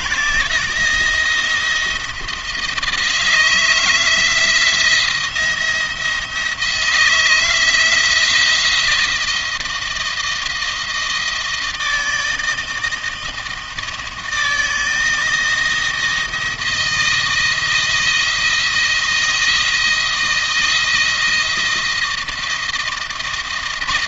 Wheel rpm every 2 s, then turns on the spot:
170, 170, 170, 160, 170, 160, 160, 160, 160, 160, 160, 160.
none